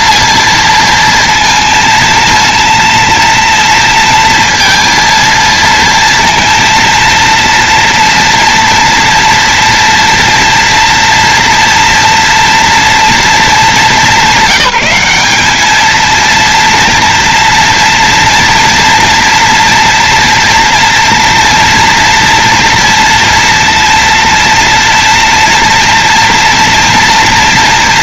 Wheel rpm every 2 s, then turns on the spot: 230, 230, 230, 230, 230, 230, 230, 180, 230, 230, 230, 230, 230, 230.
none